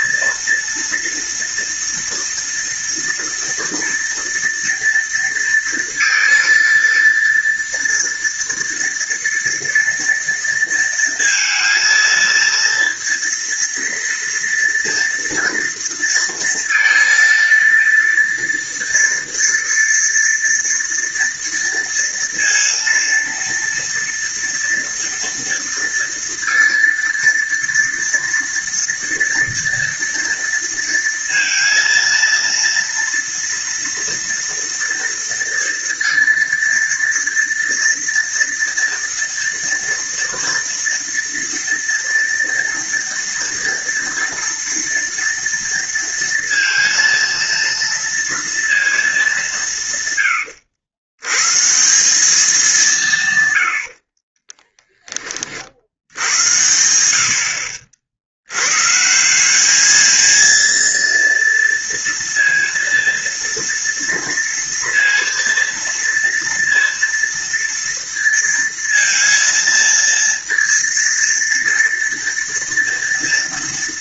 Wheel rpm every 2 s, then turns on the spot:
230, 230, 230, 230, 230, 230, 230, 230, 230, 230, 230, 230, 230, 230, 230, 230, 230, 230, 230, 230, 230, 230, 230, 230, 220, 90, 170, 30, 90, 140, 230, 230, 230, 230, 230, 230, 230.
none